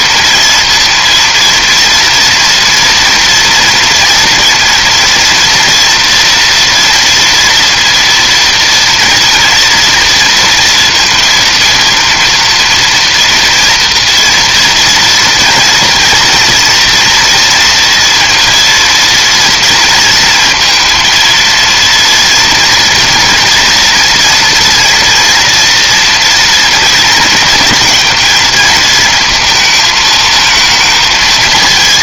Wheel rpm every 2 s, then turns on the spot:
230, 230, 230, 230, 230, 230, 230, 230, 230, 230, 230, 230, 230, 230, 220, 230.
none